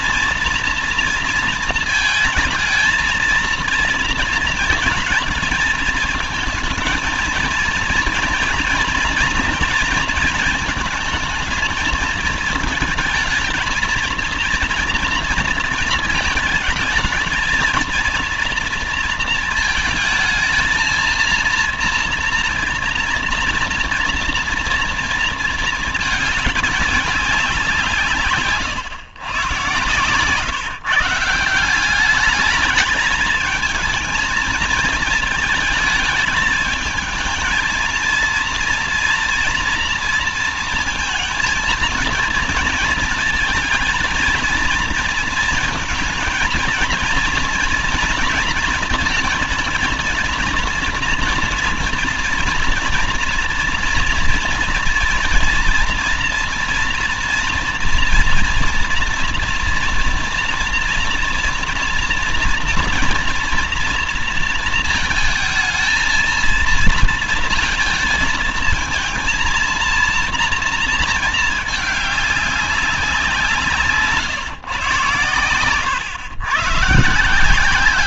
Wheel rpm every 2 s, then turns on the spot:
230, 220, 220, 220, 230, 220, 220, 240, 220, 230, 230, 230, 230, 210, 140, 150, 210, 220, 220, 230, 230, 230, 230, 230, 230, 230, 230, 230, 240, 230, 230, 230, 230, 230, 220, 220, 190, 120, 130.
none